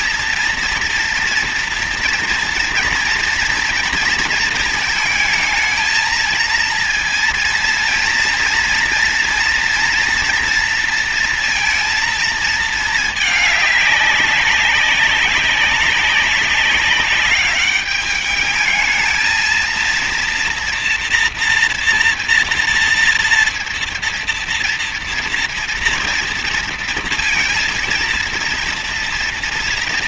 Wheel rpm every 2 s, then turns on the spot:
230, 230, 230, 230, 230, 230, 220, 200, 200, 210, 230, 230, 230, 230, 230.
none